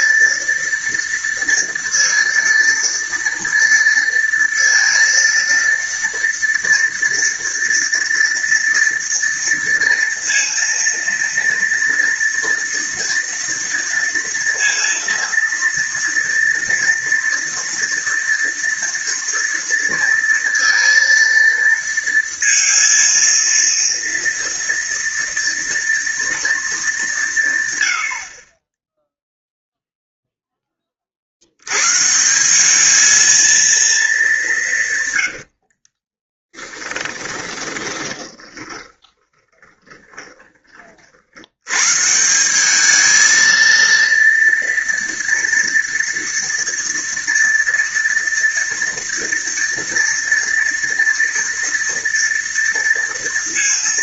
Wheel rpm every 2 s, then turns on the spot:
230, 230, 230, 230, 230, 230, 230, 230, 230, 240, 230, 230, 230, 230, 20, 10, 190, 190, 20, 20, 30, 200, 230, 230, 230, 230, 230.
36-40